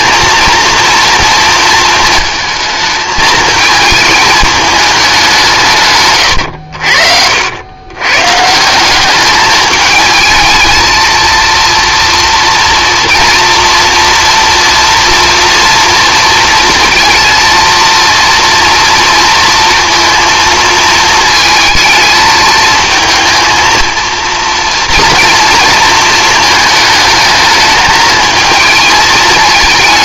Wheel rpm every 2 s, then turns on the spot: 230, 220, 210, 80, 190, 230, 240, 240, 230, 230, 230, 220, 230, 220, 220.
none